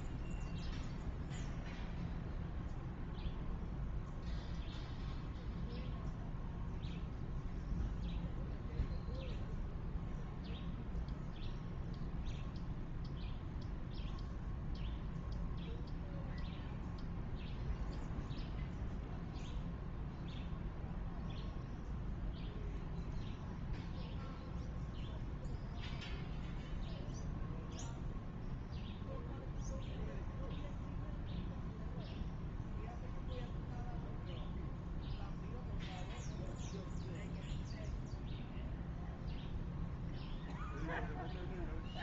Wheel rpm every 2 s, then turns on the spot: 0, 0, 0, 0, 0, 0, 0, 0, 0, 0, 0, 0, 0, 0, 0, 0, 0, 0, 0, 0, 0.
none